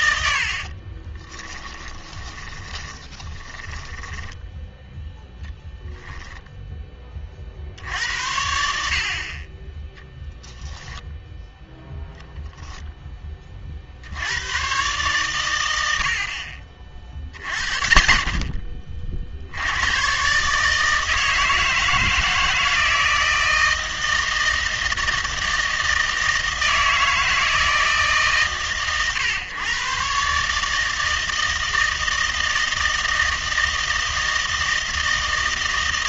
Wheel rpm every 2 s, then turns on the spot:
40, 20, 10, 20, 70, 0, 0, 120, 40, 50, 150, 160, 160, 160, 130, 160, 160, 160.
0-4 6-8